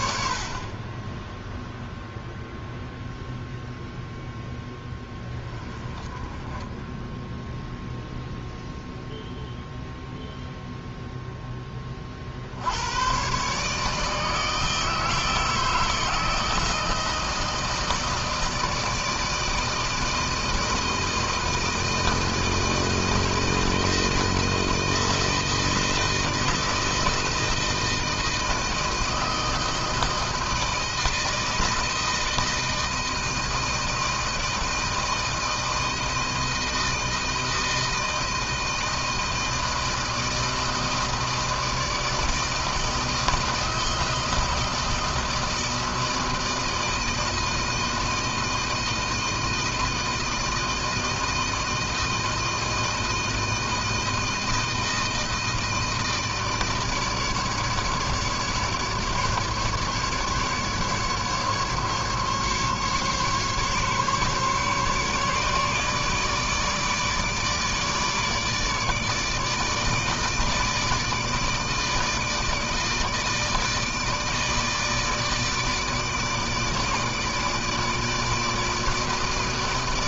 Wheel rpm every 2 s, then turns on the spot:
60, 0, 0, 20, 0, 0, 70, 160, 160, 160, 160, 160, 160, 160, 160, 160, 160, 160, 160, 160, 160, 160, 160, 160, 160, 160, 160, 160, 160, 150, 150, 140, 140, 150, 150, 160, 160, 160, 150, 160.
none